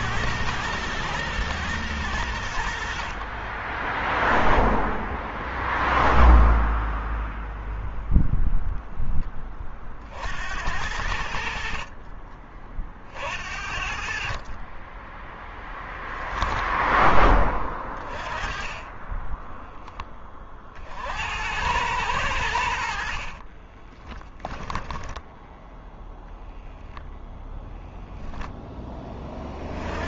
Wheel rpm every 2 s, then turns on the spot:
110, 50, 0, 0, 10, 80, 50, 10, 10, 10, 70, 50, 10, 0, 20.
10-12 22-24